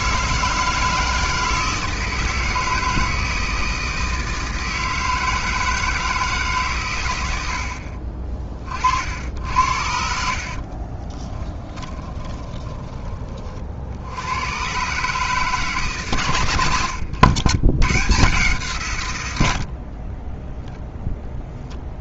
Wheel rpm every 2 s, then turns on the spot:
160, 160, 160, 130, 40, 40, 20, 140, 110, 140, 0.
10-12 16-18